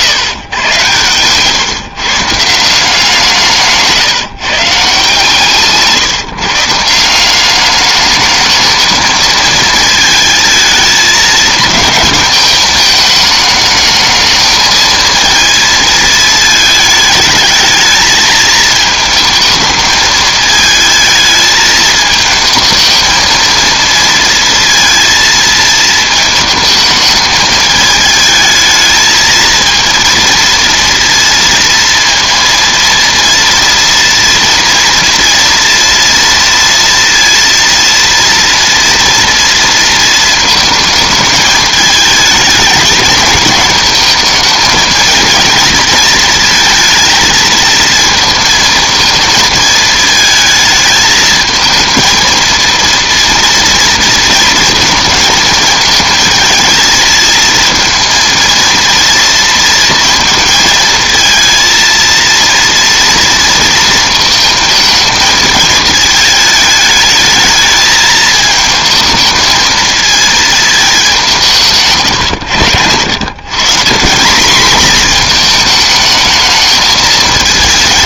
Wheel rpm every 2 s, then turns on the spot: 120, 170, 150, 170, 220, 220, 210, 220, 220, 220, 220, 220, 230, 220, 220, 230, 230, 230, 230, 230, 220, 210, 220, 220, 220, 220, 230, 230, 220, 230, 220, 230, 220, 210, 220, 210, 100, 230, 220.
0-2